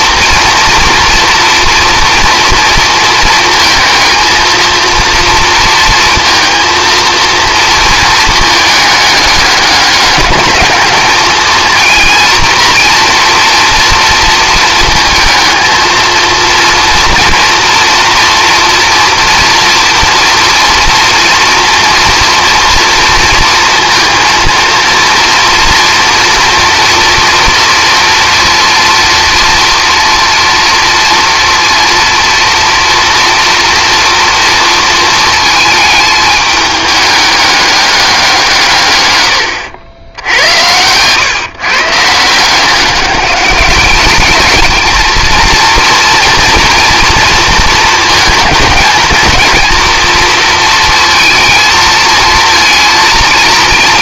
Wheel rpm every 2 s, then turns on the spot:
230, 230, 230, 230, 220, 210, 230, 230, 230, 230, 230, 230, 230, 230, 230, 230, 230, 230, 210, 150, 90, 180, 220, 240, 220, 230, 220.
none